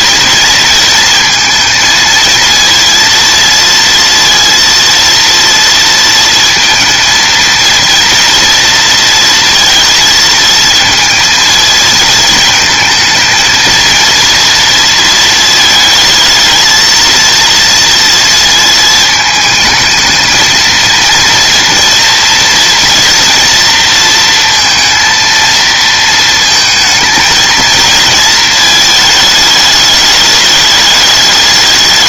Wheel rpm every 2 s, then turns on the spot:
230, 230, 230, 230, 230, 230, 220, 230, 230, 220, 220, 230, 230, 220, 220, 210.
none